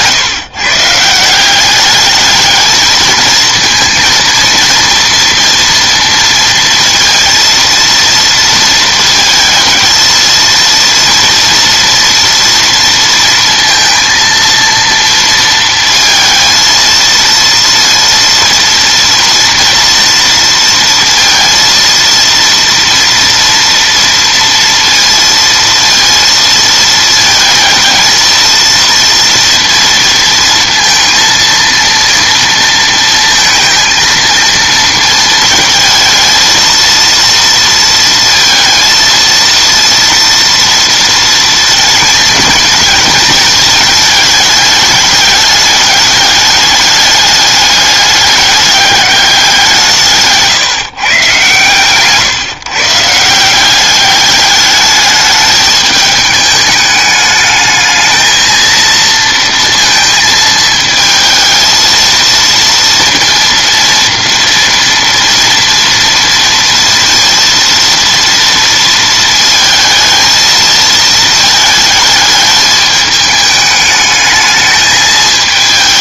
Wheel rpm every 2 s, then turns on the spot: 150, 220, 230, 230, 230, 230, 230, 230, 230, 230, 230, 230, 230, 230, 230, 230, 230, 230, 230, 230, 230, 220, 210, 210, 210, 150, 140, 210, 210, 230, 220, 230, 230, 230, 230, 220, 210, 220.
none